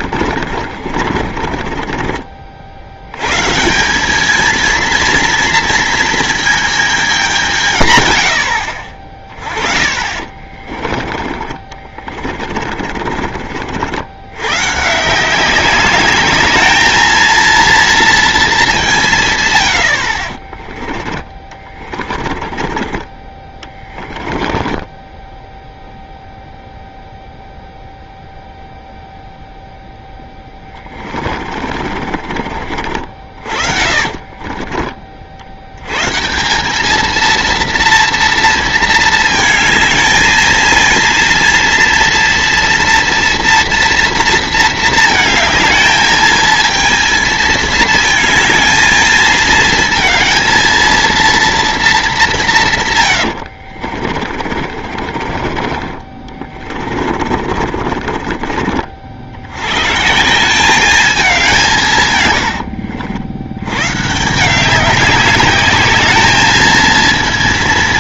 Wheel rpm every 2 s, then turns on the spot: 50, 70, 230, 220, 60, 30, 30, 130, 210, 200, 30, 30, 30, 0, 0, 20, 50, 40, 190, 230, 230, 230, 230, 220, 220, 220, 150, 40, 40, 50, 190, 100, 170, 220.
0-2 10-14 20-22 24-26 30-32 52-58 62-64